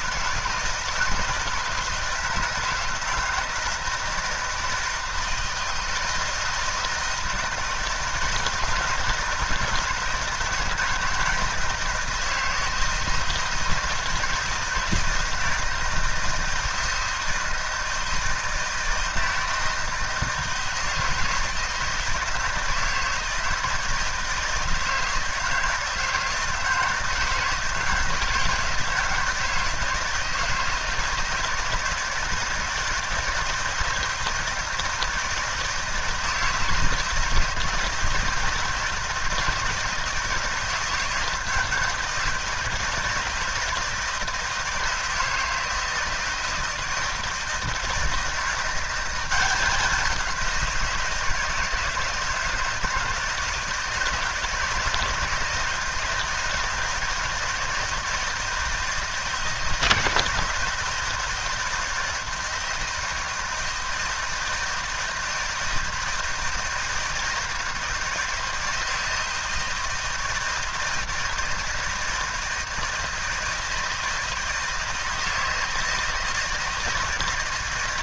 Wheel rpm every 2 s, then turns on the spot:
160, 160, 160, 160, 160, 160, 160, 160, 160, 160, 160, 160, 160, 160, 160, 160, 160, 160, 160, 160, 160, 160, 160, 160, 180, 180, 160, 160, 160, 160, 170, 160, 160, 170, 160, 160, 160, 160, 160.
none